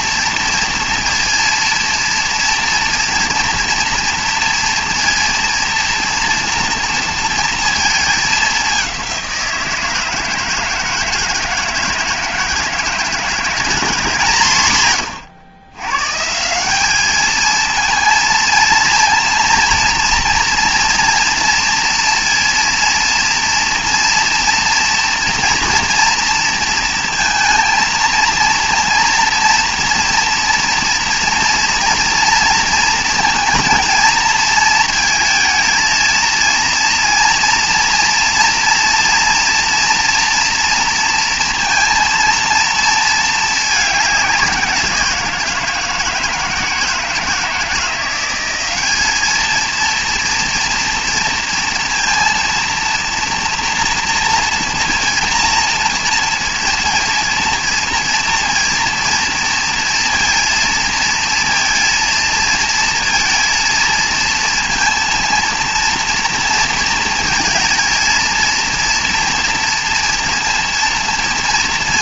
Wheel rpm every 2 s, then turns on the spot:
230, 230, 230, 230, 190, 160, 160, 150, 190, 230, 230, 230, 240, 230, 230, 230, 230, 230, 230, 240, 240, 230, 180, 170, 190, 230, 230, 230, 230, 230, 230, 230, 230, 230, 230, 230.
none